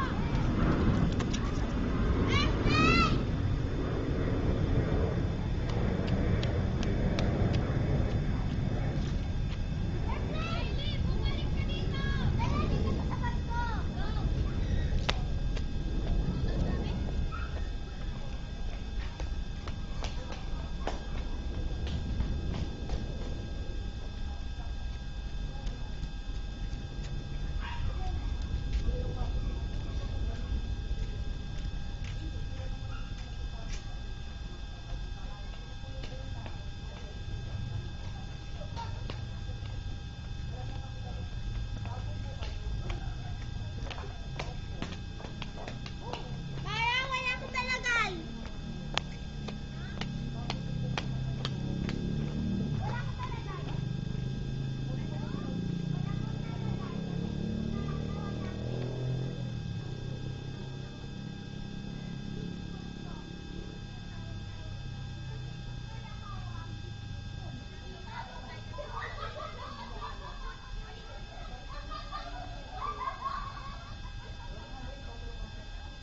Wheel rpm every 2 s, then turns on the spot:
0, 0, 0, 0, 0, 0, 0, 0, 0, 0, 0, 0, 0, 0, 0, 0, 0, 0, 0, 0, 0, 0, 0, 0, 0, 0, 0, 0, 0, 0, 0, 0, 0, 0, 0, 0, 0, 0.
none